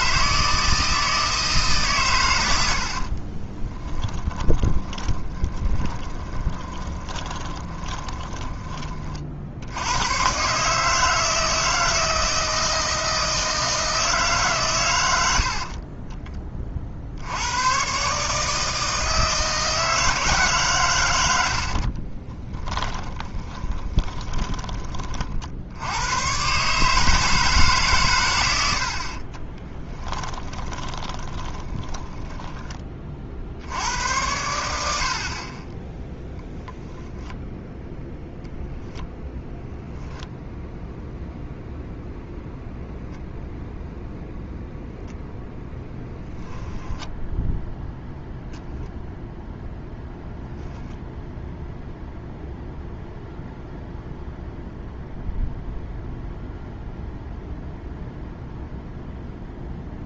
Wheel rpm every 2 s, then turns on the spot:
160, 80, 20, 20, 30, 150, 160, 130, 40, 160, 140, 10, 20, 140, 90, 30, 20, 80, 0, 0, 0, 0, 0, 0, 0, 0, 0, 0, 0, 0.
2-10 22-24 30-32